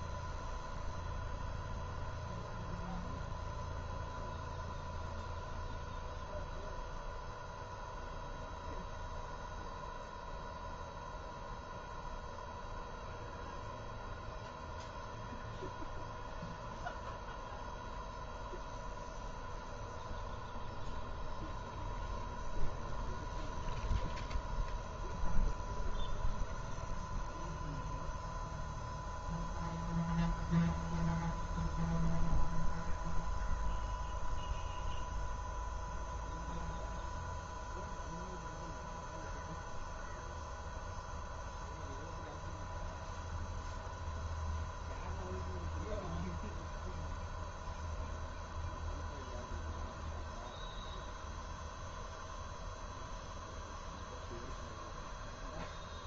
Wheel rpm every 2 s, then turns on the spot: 0, 0, 0, 0, 0, 0, 0, 0, 0, 0, 0, 0, 0, 0, 0, 0, 0, 0, 0, 0, 0, 0, 0, 0, 0, 0, 0, 0.
none